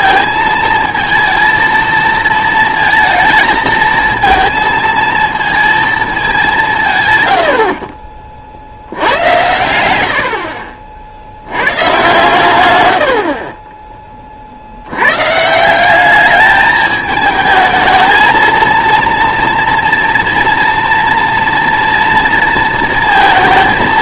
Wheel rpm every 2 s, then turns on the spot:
220, 230, 230, 170, 70, 40, 90, 80, 210, 230, 230, 230.
none